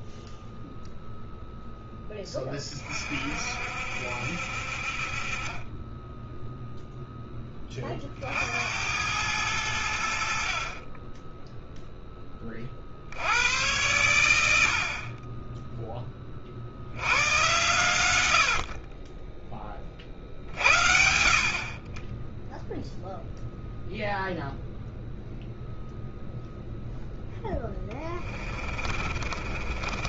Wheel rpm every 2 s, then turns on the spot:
0, 30, 50, 0, 80, 20, 50, 60, 70, 50, 50, 0, 0, 0, 30.
28-30